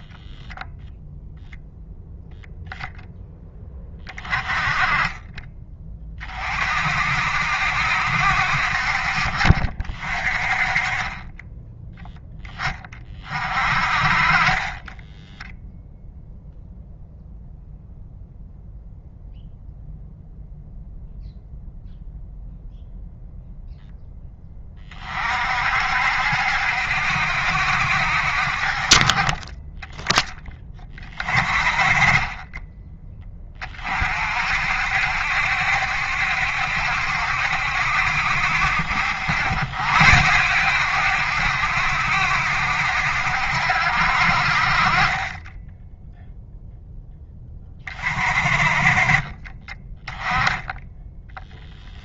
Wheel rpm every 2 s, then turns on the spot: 10, 0, 20, 50, 50, 30, 20, 20, 0, 0, 0, 0, 20, 60, 40, 20, 20, 60, 70, 60, 80, 70, 40, 0, 40, 10.
14-16